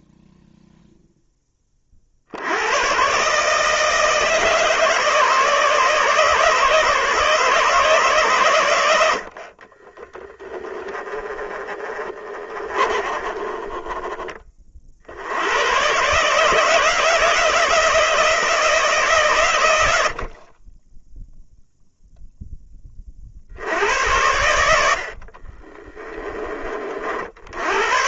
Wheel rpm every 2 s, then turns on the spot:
0, 100, 150, 150, 120, 20, 30, 30, 150, 160, 20, 10, 80, 30.
10-14